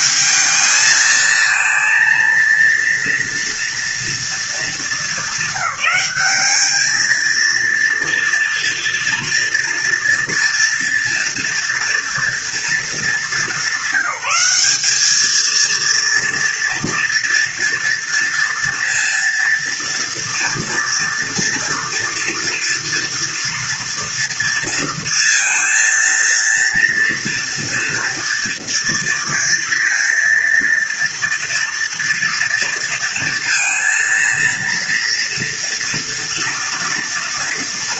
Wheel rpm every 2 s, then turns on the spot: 220, 230, 210, 220, 230, 230, 220, 210, 230, 230, 230, 230, 230, 230, 230, 230, 230, 230, 230.
none